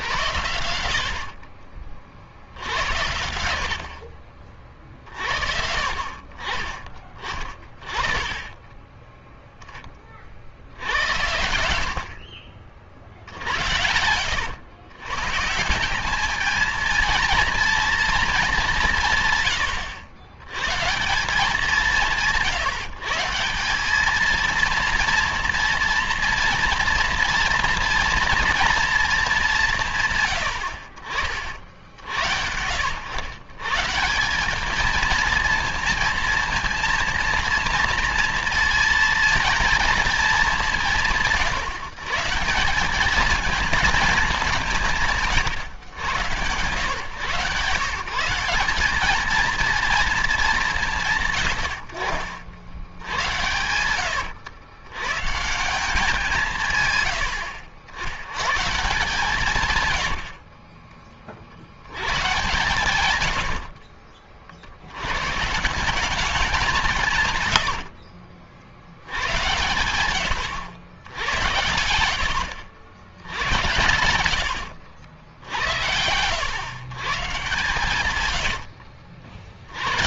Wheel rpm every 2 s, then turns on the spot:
70, 70, 40, 40, 20, 60, 60, 100, 220, 210, 120, 150, 230, 230, 230, 100, 80, 200, 230, 230, 190, 170, 180, 110, 190, 190, 70, 90, 160, 130, 40, 120, 50, 180, 60, 80, 80, 80, 110, 80.
62-64 78-80